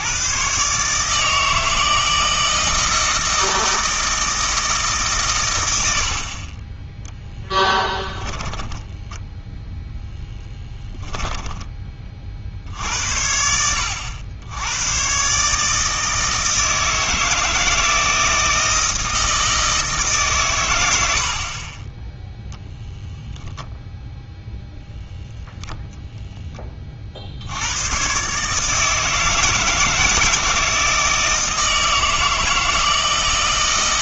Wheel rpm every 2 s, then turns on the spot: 140, 160, 150, 20, 10, 10, 60, 90, 160, 160, 110, 0, 0, 10, 150, 160, 160.
8-10